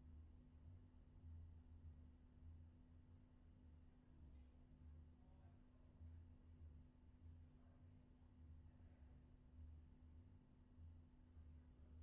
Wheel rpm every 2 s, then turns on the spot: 0, 0, 0, 0, 0, 0.
none